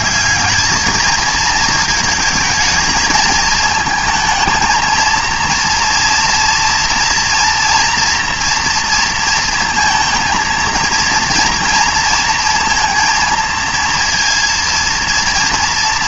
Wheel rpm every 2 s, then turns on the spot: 210, 220, 220, 230, 230, 230, 230, 230.
none